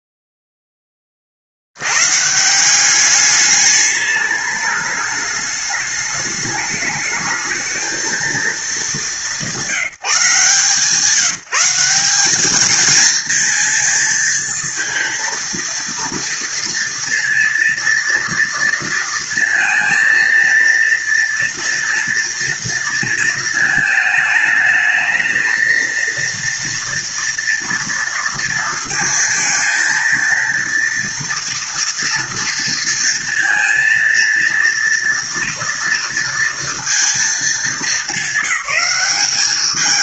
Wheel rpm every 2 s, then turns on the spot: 0, 160, 210, 210, 220, 150, 210, 230, 230, 230, 230, 230, 220, 230, 230, 230, 230, 230, 230, 200.
none